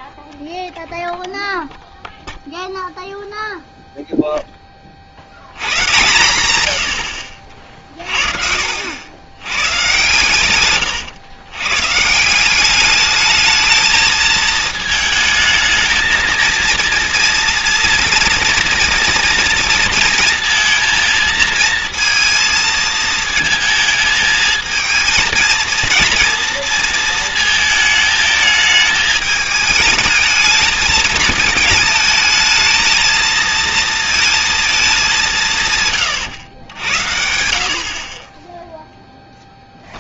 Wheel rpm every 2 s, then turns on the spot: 0, 0, 10, 110, 70, 120, 200, 220, 230, 230, 230, 230, 220, 230, 220, 220, 220, 210, 100, 10.
none